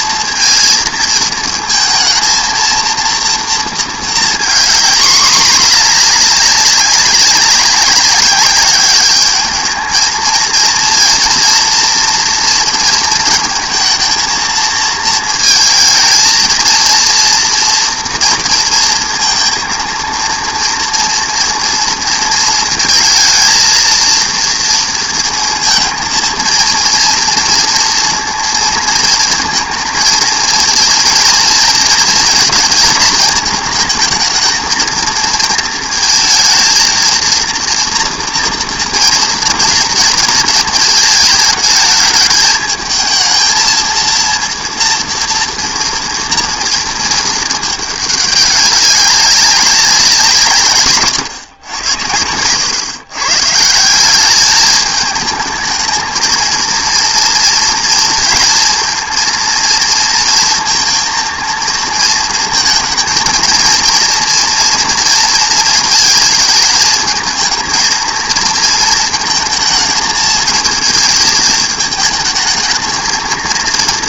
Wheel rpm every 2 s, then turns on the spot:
230, 230, 230, 200, 200, 220, 230, 230, 230, 230, 230, 230, 230, 230, 230, 220, 220, 220, 220, 230, 220, 210, 230, 230, 200, 160, 110, 210, 230, 230, 230, 230, 240, 220, 230, 220, 220.
none